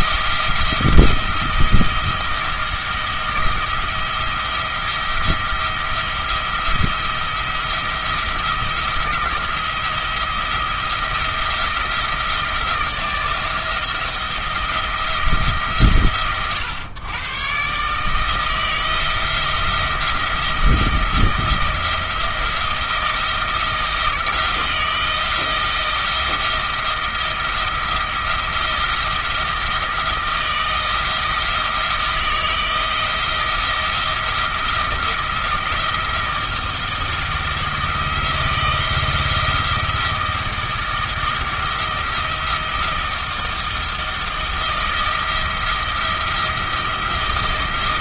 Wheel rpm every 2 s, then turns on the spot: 170, 170, 170, 170, 170, 170, 170, 170, 120, 160, 170, 170, 160, 170, 170, 170, 170, 170, 170, 170, 170, 170, 170, 160.
none